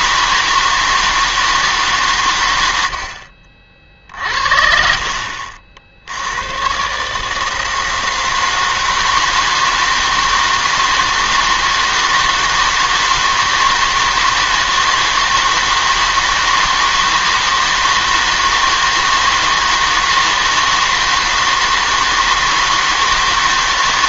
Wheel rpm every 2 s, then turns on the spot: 160, 100, 50, 130, 160, 160, 160, 160, 160, 160, 160, 160.
none